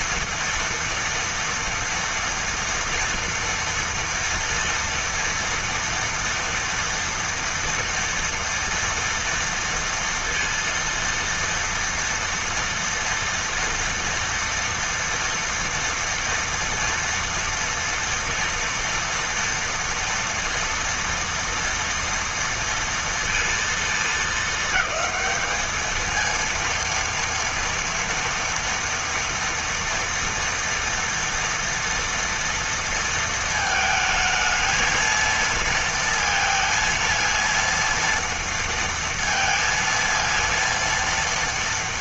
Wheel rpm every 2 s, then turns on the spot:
230, 230, 240, 230, 230, 230, 230, 230, 230, 230, 230, 230, 210, 230, 230, 230, 230, 230, 230, 230, 230.
none